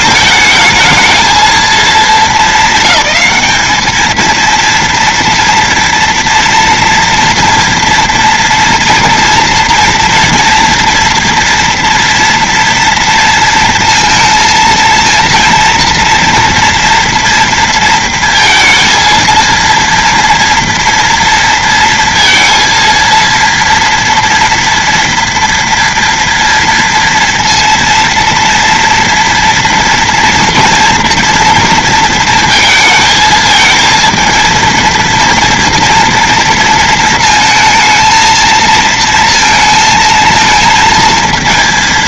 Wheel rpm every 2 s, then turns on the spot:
220, 210, 220, 230, 230, 230, 230, 230, 230, 230, 230, 230, 230, 240, 230, 230, 230, 230, 230, 220, 220.
none